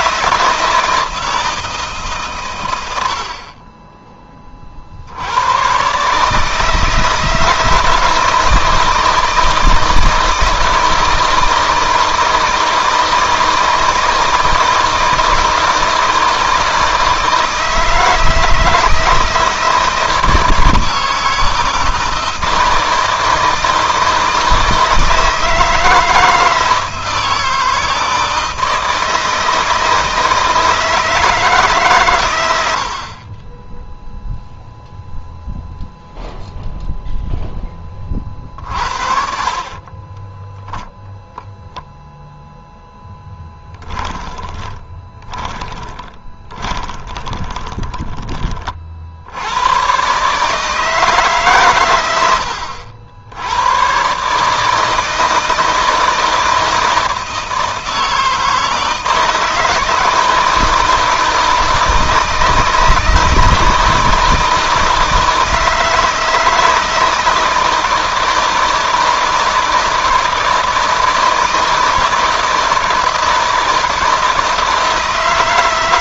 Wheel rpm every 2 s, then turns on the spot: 160, 70, 60, 160, 160, 160, 160, 160, 160, 160, 160, 160, 160, 160, 160, 160, 60, 0, 0, 50, 0, 0, 20, 20, 60, 150, 80, 160, 160, 160, 160, 160, 160, 160, 160, 160, 160, 160.
38-40 44-48